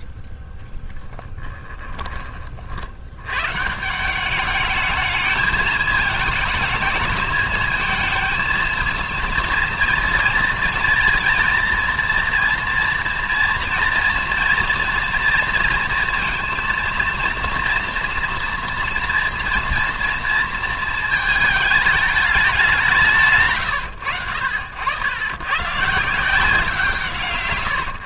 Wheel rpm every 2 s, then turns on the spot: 10, 90, 220, 210, 230, 230, 230, 230, 230, 240, 220, 160, 90, 140.
0-2